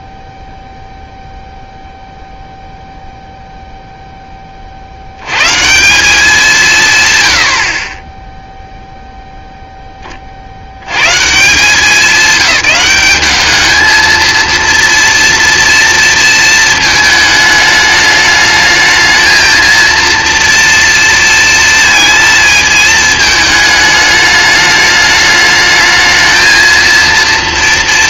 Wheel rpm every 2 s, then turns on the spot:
0, 0, 100, 120, 0, 100, 200, 230, 220, 220, 230, 220, 210, 230.
none